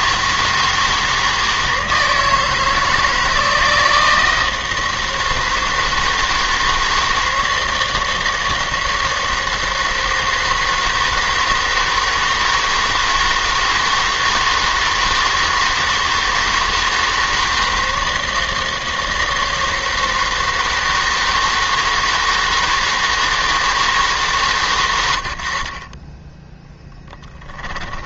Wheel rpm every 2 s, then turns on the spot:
160, 160, 160, 160, 160, 160, 160, 160, 160, 160, 160, 160, 110, 0.
none